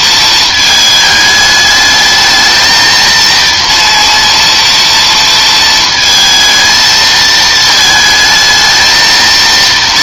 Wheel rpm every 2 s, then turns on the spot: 220, 220, 230, 220, 220.
none